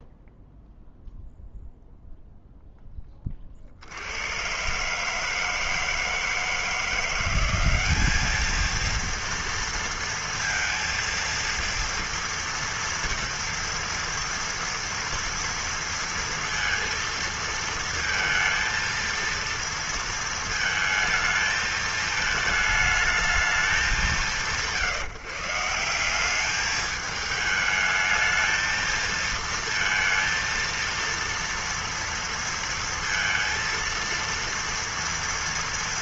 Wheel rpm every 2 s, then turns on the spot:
0, 0, 100, 160, 210, 230, 230, 230, 230, 230, 230, 220, 180, 190, 220, 230, 230, 230.
none